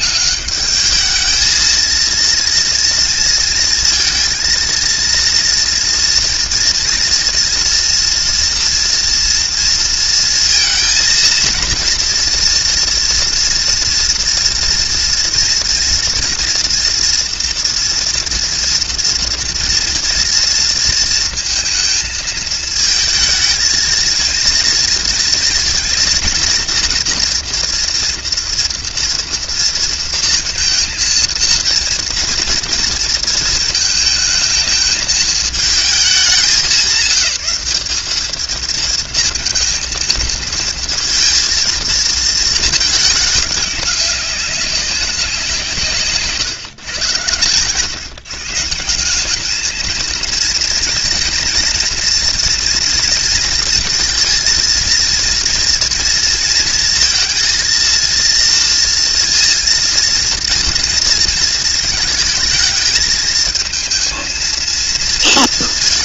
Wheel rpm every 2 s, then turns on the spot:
210, 230, 230, 230, 230, 230, 230, 240, 230, 230, 230, 220, 230, 230, 230, 230, 230, 220, 190, 220, 230, 220, 200, 130, 160, 230, 240, 230, 230, 230, 230, 220, 230.
none